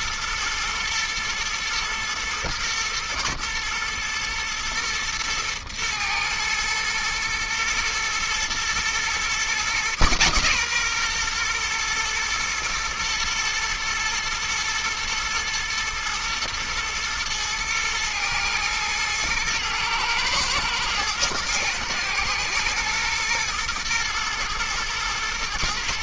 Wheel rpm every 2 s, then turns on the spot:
120, 120, 110, 120, 130, 120, 110, 110, 110, 120, 110, 120, 120.
none